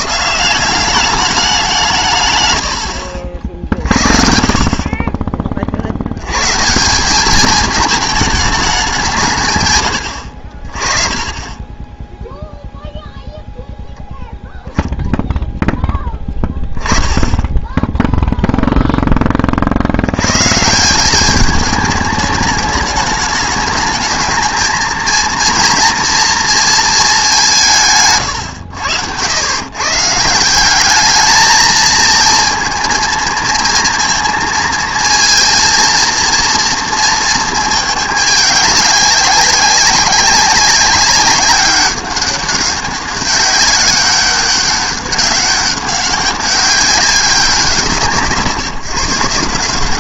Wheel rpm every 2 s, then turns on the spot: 180, 110, 60, 140, 210, 50, 0, 0, 10, 0, 140, 210, 220, 230, 100, 190, 230, 220, 230, 210, 190, 200, 200, 190, 160.
none